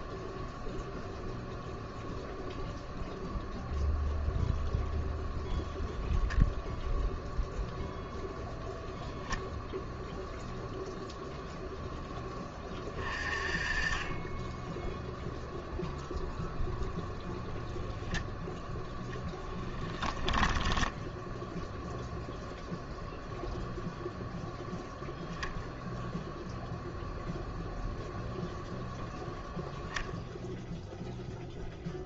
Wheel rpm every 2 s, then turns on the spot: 0, 0, 0, 0, 10, 0, 20, 10, 0, 0, 10, 0, 0, 0, 0, 0.
20-22